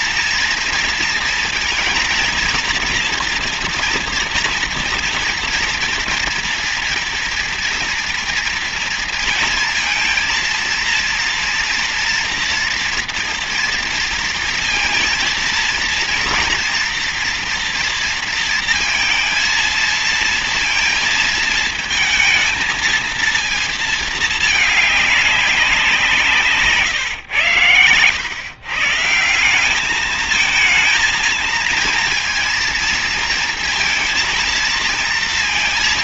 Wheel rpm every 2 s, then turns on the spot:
230, 230, 230, 240, 230, 230, 230, 230, 230, 230, 230, 220, 220, 160, 130, 220, 230, 230.
none